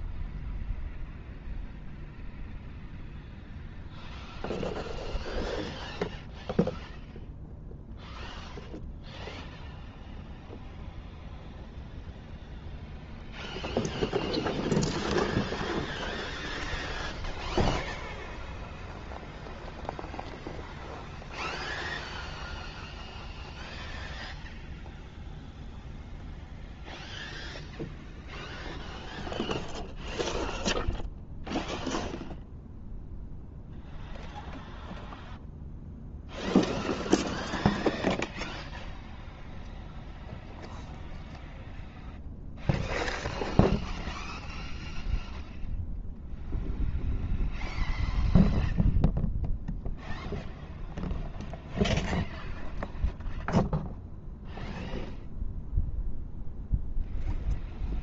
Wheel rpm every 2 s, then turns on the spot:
0, 0, 0, 0, 0, 0, 0, 0, 0, 0, 0, 0, 0, 0, 0, 0, 0, 0, 0, 0, 0, 0, 0, 0, 0, 0, 0, 0, 0.
none